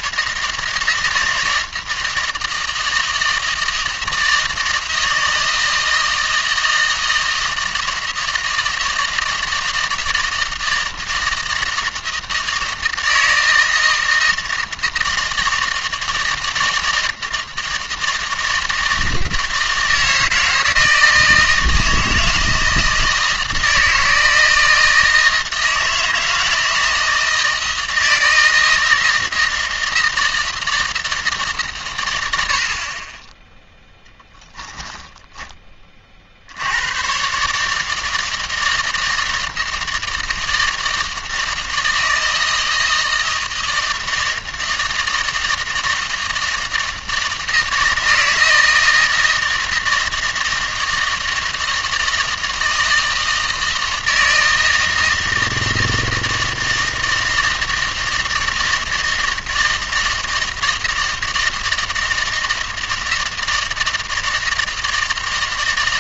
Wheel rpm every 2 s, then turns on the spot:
160, 160, 160, 160, 160, 160, 160, 160, 160, 160, 160, 160, 160, 160, 160, 160, 50, 10, 100, 160, 160, 160, 160, 160, 160, 160, 160, 160, 160, 160, 160, 160, 160.
34-36